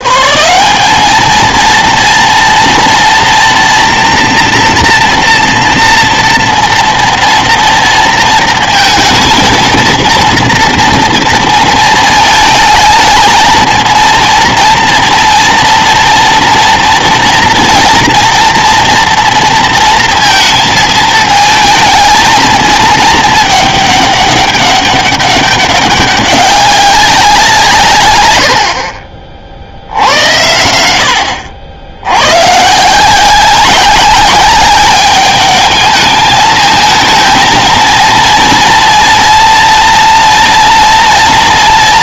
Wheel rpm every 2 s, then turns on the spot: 200, 230, 230, 230, 230, 230, 220, 230, 230, 230, 220, 220, 200, 190, 50, 80, 160, 210, 220, 240, 230.
none